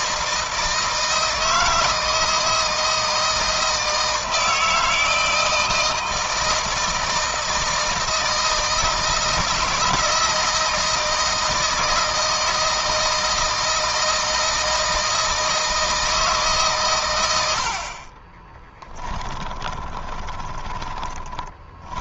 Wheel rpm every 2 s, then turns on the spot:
160, 160, 160, 160, 160, 160, 160, 160, 140, 20, 30.
18-22